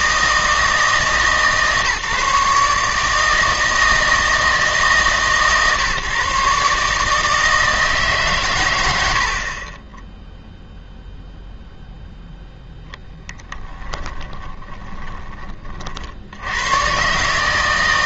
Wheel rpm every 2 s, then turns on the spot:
160, 150, 160, 140, 120, 0, 0, 20, 110.
14-16